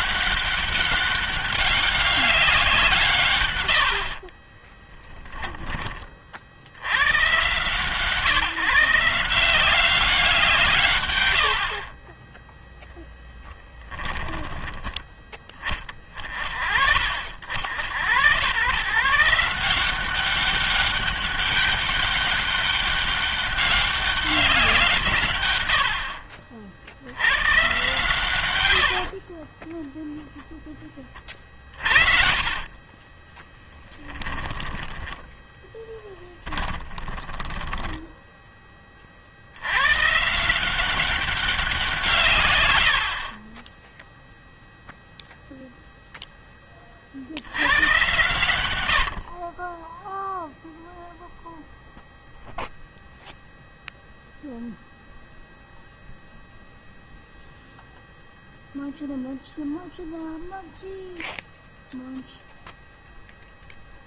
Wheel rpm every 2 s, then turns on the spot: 200, 160, 10, 100, 160, 120, 0, 10, 50, 130, 200, 200, 150, 80, 70, 10, 30, 10, 10, 30, 180, 80, 0, 30, 80, 0, 0, 0, 0, 0, 0, 0.
4-6 28-30 32-34 36-38 42-44